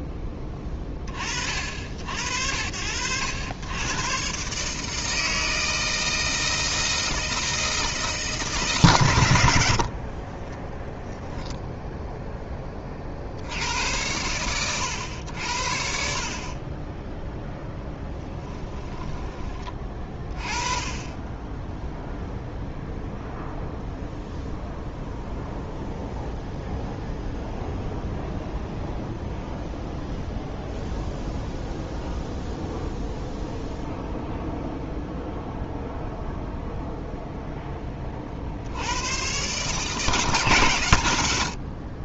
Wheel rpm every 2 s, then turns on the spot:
60, 120, 160, 160, 20, 0, 100, 50, 0, 20, 0, 0, 0, 0, 0, 0, 0, 0, 0, 120, 110.
none